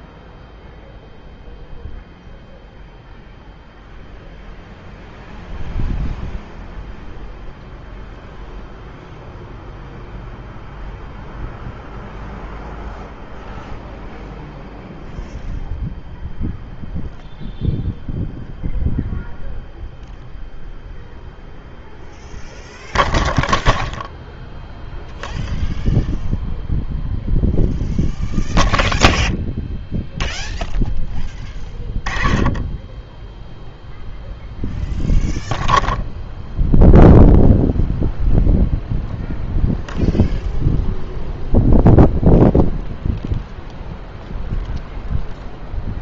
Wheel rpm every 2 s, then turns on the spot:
0, 0, 0, 0, 0, 0, 0, 0, 0, 0, 0, 0, 0, 0, 0, 0, 20, 0, 0, 0, 0, 0, 0.
none